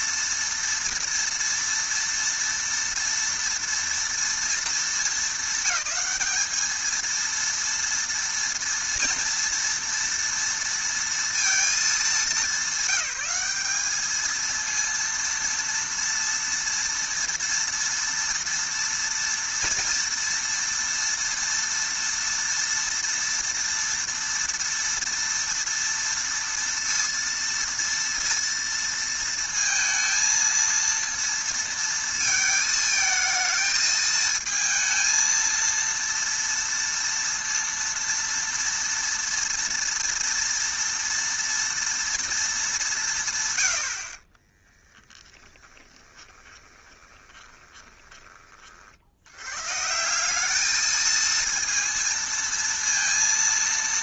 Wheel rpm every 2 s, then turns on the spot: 230, 230, 220, 220, 230, 230, 200, 230, 230, 230, 230, 230, 230, 230, 230, 230, 220, 230, 230, 230, 230, 190, 30, 20, 50, 220, 230.
44-48